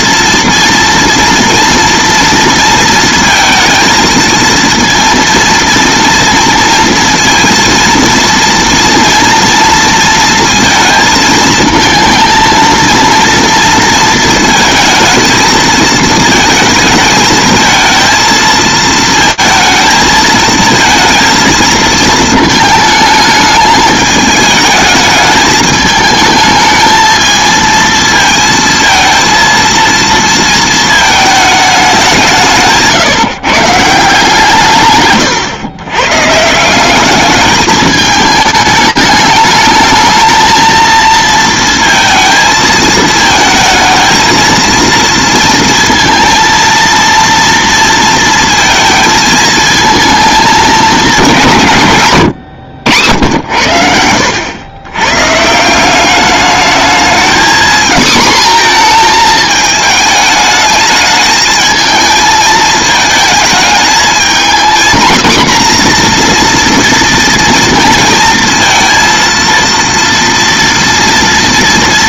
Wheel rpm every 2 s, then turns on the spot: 230, 230, 230, 230, 230, 230, 230, 230, 220, 220, 220, 220, 210, 220, 230, 230, 150, 150, 170, 210, 230, 220, 230, 230, 230, 220, 90, 90, 210, 230, 210, 220, 240, 230, 230, 230.
none